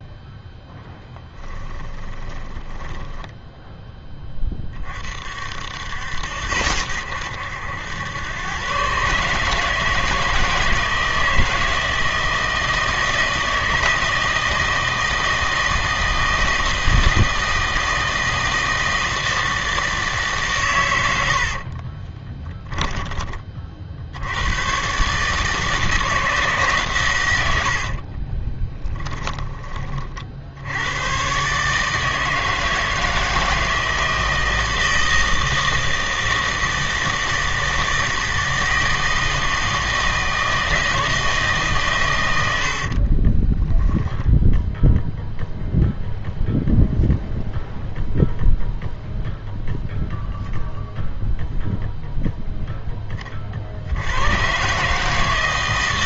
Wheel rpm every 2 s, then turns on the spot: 0, 10, 30, 80, 120, 160, 160, 160, 160, 160, 120, 10, 120, 150, 20, 80, 160, 160, 160, 160, 160, 70, 0, 0, 0, 0, 20, 140.
2-4 22-24 28-30 42-44